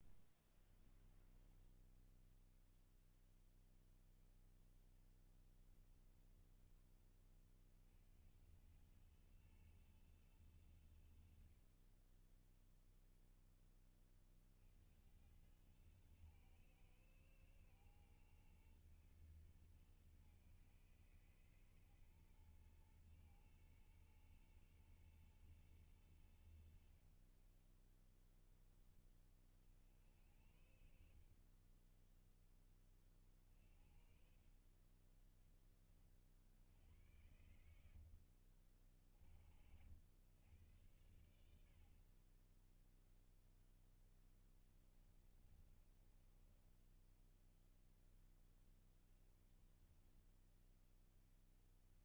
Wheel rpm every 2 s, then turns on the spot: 10, 0, 0, 20, 80, 110, 10, 50, 110, 120, 110, 110, 110, 90, 10, 60, 20, 50, 70, 60, 90, 20, 10, 20, 10, 10.
30-32 34-36 38-40 44-48